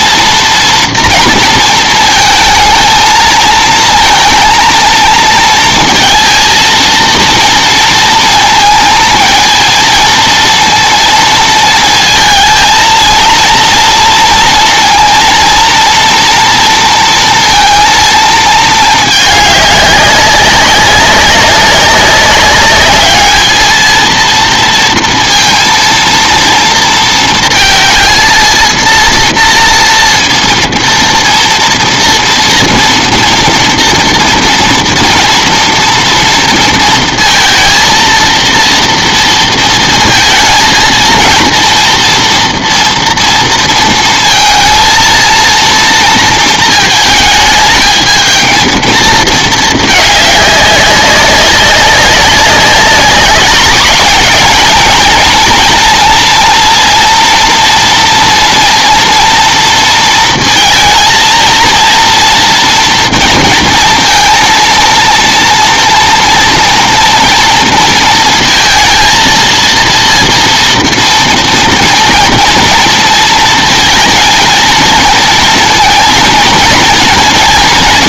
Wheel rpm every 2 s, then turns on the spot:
230, 220, 230, 230, 220, 230, 230, 230, 230, 210, 190, 210, 230, 230, 230, 230, 230, 230, 230, 230, 230, 240, 230, 220, 220, 200, 200, 220, 230, 240, 230, 240, 230, 230, 230, 230, 230, 230, 230.
none